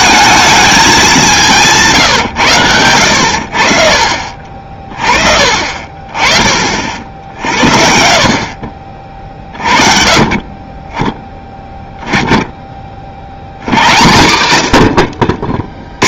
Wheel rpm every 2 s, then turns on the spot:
220, 100, 40, 50, 40, 20, 10, 110.
none